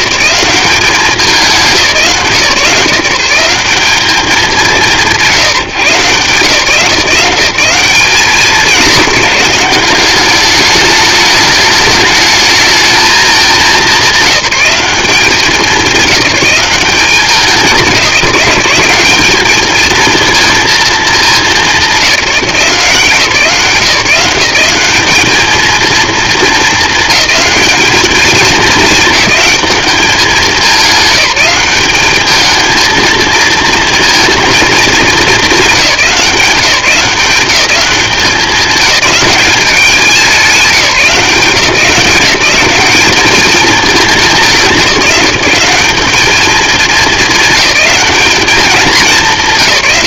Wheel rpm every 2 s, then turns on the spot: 190, 180, 180, 170, 190, 210, 220, 200, 190, 180, 220, 160, 190, 220, 220, 200, 220, 210, 170, 210, 190, 200, 170, 220, 200.
none